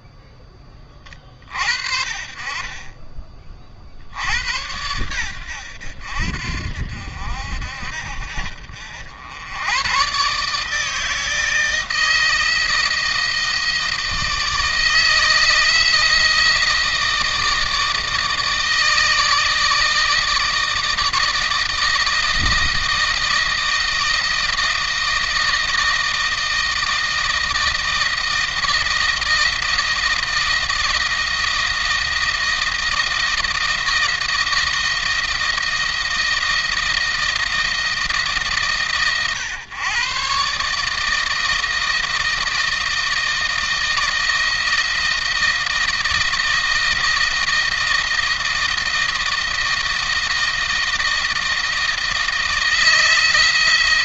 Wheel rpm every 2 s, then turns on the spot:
20, 30, 90, 70, 70, 150, 160, 160, 160, 160, 160, 160, 160, 160, 160, 170, 170, 160, 160, 140, 150, 160, 160, 160, 160, 160, 160.
none